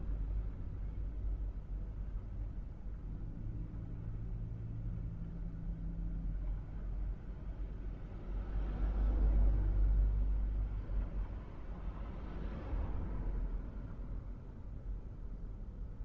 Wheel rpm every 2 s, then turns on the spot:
0, 0, 0, 0, 0, 0, 0, 0.
none